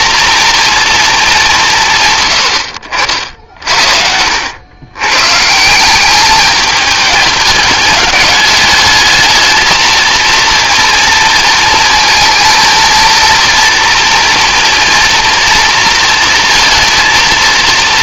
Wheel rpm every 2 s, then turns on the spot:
230, 90, 90, 210, 210, 230, 230, 230, 230.
none